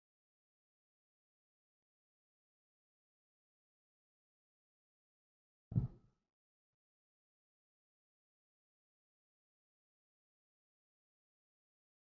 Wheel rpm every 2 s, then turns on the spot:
0, 0, 0, 0, 0, 0.
none